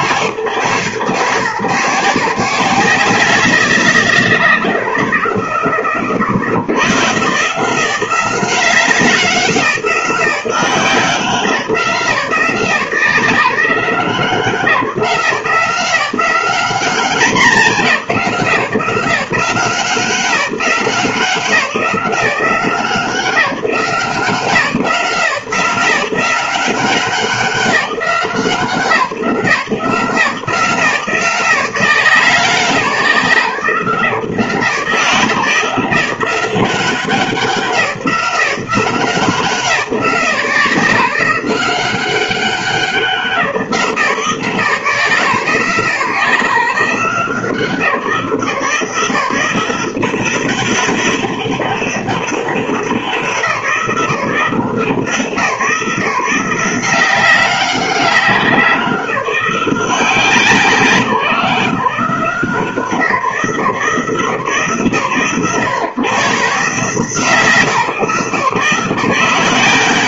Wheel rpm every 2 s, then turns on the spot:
130, 180, 90, 110, 180, 180, 170, 160, 190, 160, 180, 170, 160, 180, 160, 170, 170, 160, 180, 160, 170, 180, 130, 150, 160, 200, 180, 160, 190, 180, 150, 160, 120, 150, 160.
none